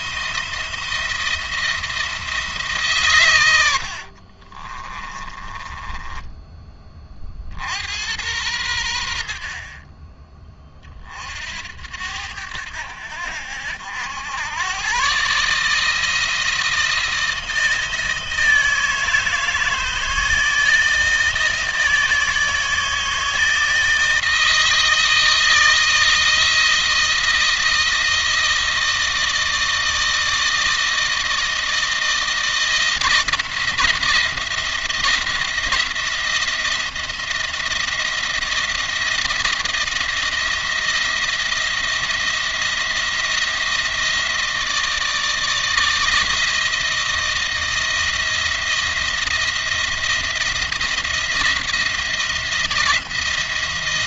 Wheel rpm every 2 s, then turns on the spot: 170, 140, 30, 20, 90, 30, 80, 120, 160, 160, 160, 160, 160, 160, 160, 160, 170, 170, 170, 170, 170, 170, 160, 160, 170, 160, 170.
4-6